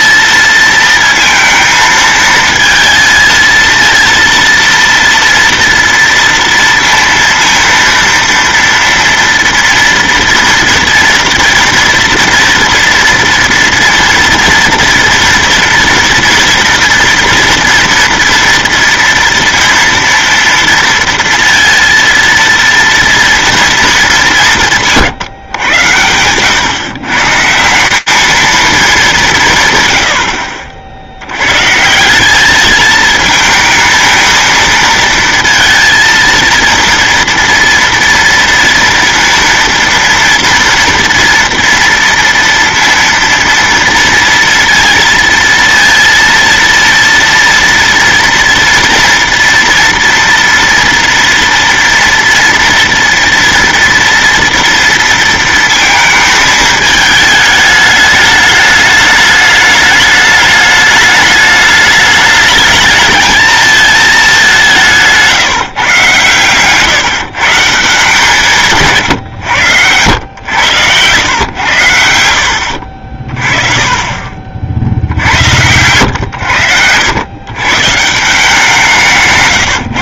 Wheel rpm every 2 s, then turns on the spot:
230, 230, 230, 230, 230, 230, 240, 230, 230, 230, 230, 230, 140, 140, 200, 70, 220, 230, 230, 230, 230, 230, 230, 230, 230, 230, 230, 230, 210, 210, 210, 210, 170, 140, 140, 110, 60, 70, 90, 170.
68-70 72-76